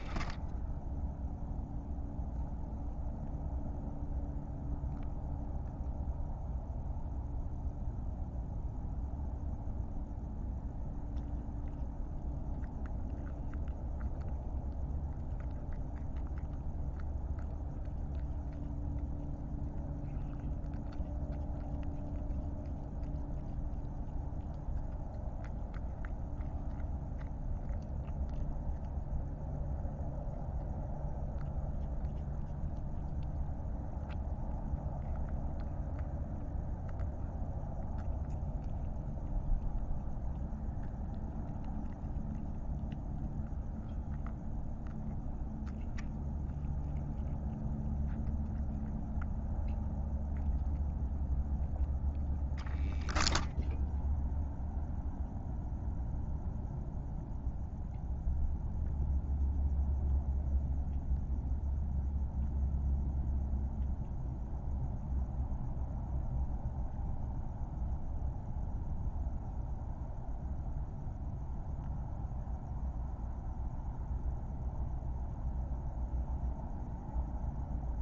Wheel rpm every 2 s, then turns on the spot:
0, 0, 0, 0, 0, 0, 0, 0, 0, 0, 0, 0, 0, 0, 0, 0, 0, 0, 0, 0, 0, 0, 0, 0, 0, 0, 0, 0, 0, 0, 0, 0, 0, 0, 0, 0, 0, 0, 0.
none